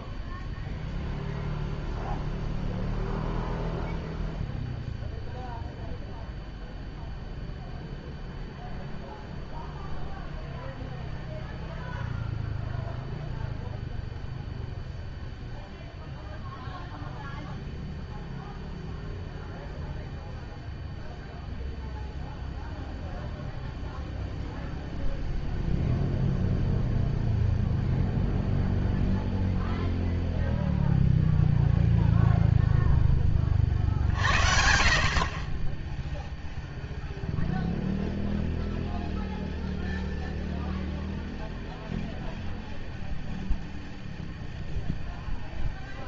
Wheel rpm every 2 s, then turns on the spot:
0, 0, 0, 0, 0, 0, 0, 0, 0, 0, 0, 0, 0, 0, 0, 0, 0, 70, 0, 0, 0, 0, 0.
none